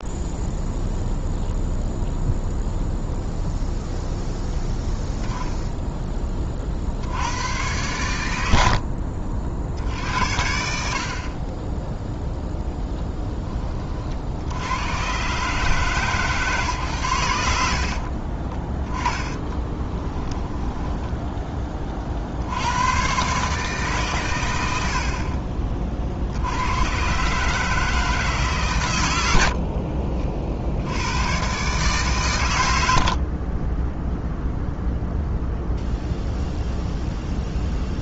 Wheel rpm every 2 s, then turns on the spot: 0, 0, 0, 60, 60, 60, 0, 90, 120, 10, 10, 100, 80, 100, 120, 70, 90, 0, 0.
8-10 18-22